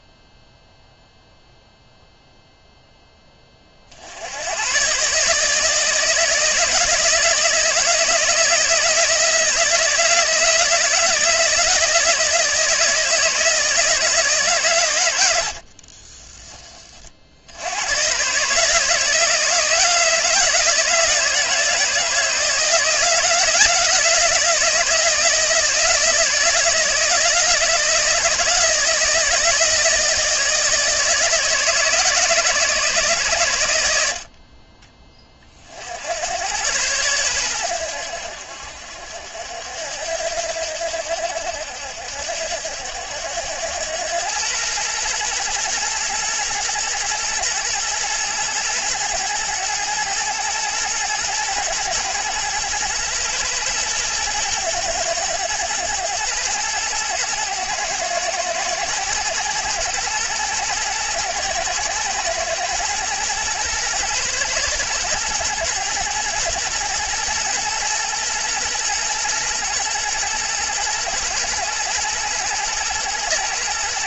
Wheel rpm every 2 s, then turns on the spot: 0, 10, 130, 170, 170, 160, 160, 110, 40, 160, 160, 170, 170, 160, 160, 160, 150, 30, 100, 60, 70, 80, 110, 120, 110, 120, 120, 110, 110, 110, 120, 110, 110, 110, 120, 110, 110.
none